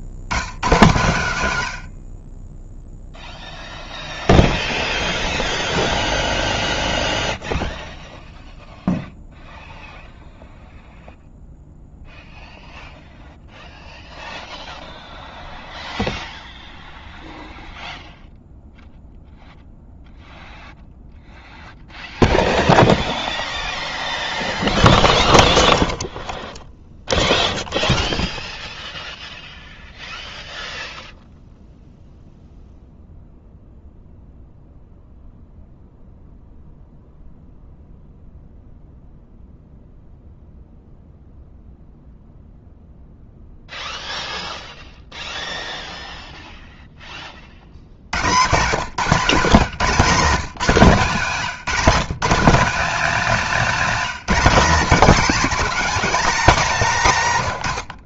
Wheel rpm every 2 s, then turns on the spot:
110, 20, 0, 0, 0, 0, 0, 0, 0, 0, 0, 0, 0, 0, 0, 0, 0, 0, 0, 0, 0, 0, 0, 0, 160, 180, 230, 240, 240.
none